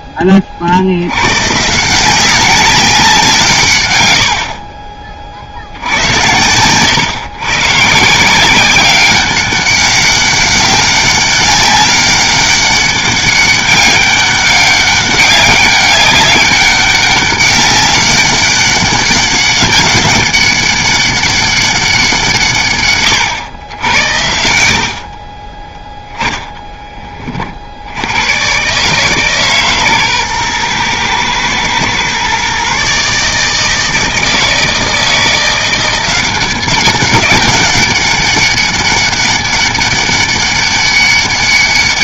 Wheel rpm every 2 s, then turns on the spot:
40, 190, 60, 100, 180, 200, 200, 200, 200, 200, 200, 150, 80, 10, 120, 120, 130, 160, 190, 200, 200.
none